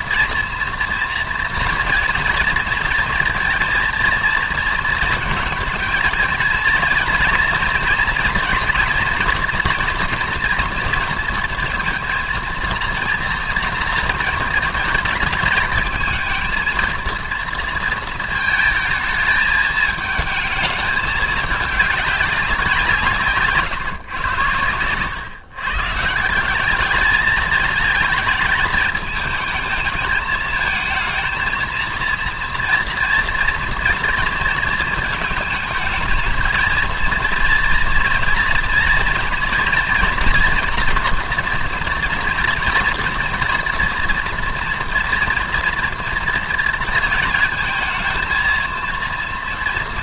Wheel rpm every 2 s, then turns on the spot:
240, 230, 230, 230, 230, 230, 230, 220, 230, 220, 210, 160, 120, 210, 220, 220, 230, 220, 230, 240, 240, 230, 230, 230, 230.
none